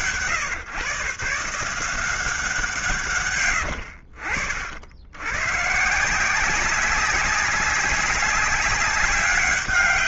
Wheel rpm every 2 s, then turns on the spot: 140, 160, 70, 190, 200.
none